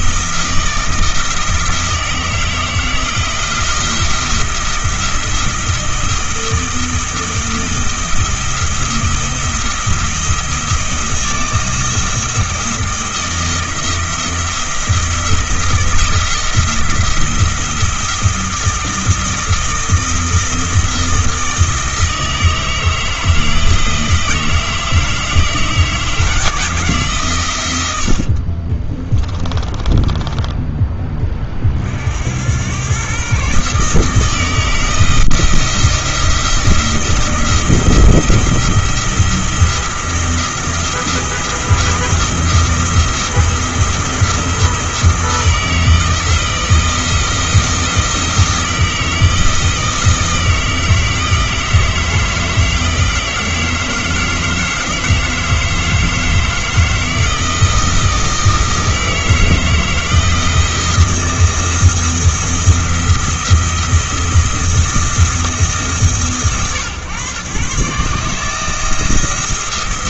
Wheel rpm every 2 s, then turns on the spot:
160, 160, 170, 160, 170, 170, 170, 170, 160, 170, 170, 160, 160, 160, 40, 10, 100, 160, 170, 170, 170, 170, 160, 160, 160, 160, 160, 160, 160, 160, 170, 170, 170, 130, 160.
28-30